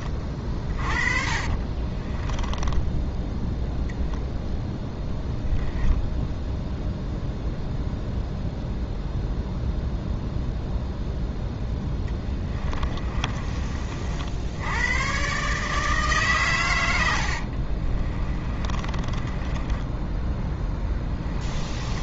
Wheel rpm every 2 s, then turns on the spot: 40, 10, 0, 0, 0, 0, 20, 100, 100, 30, 10.
0-4 12-14 16-22